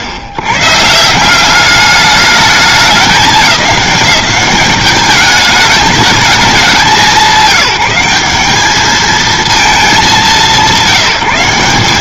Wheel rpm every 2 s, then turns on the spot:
110, 210, 200, 200, 200, 170.
none